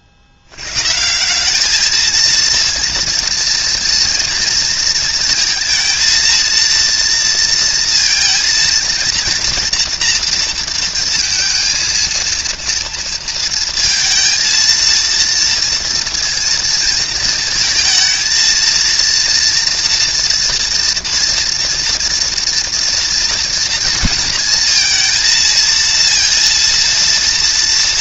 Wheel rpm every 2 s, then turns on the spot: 70, 230, 230, 230, 230, 230, 230, 230, 230, 230, 230, 240, 230, 230.
none